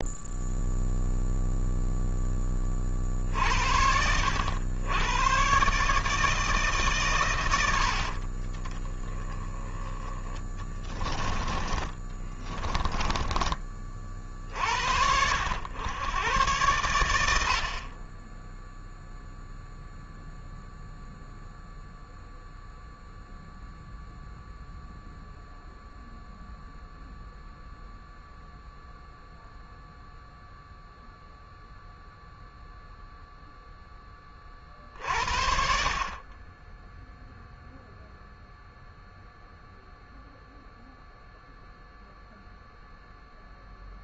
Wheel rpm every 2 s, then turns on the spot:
0, 30, 110, 140, 20, 10, 10, 70, 100, 0, 0, 0, 0, 0, 0, 0, 0, 40, 10, 0, 0, 0.
12-14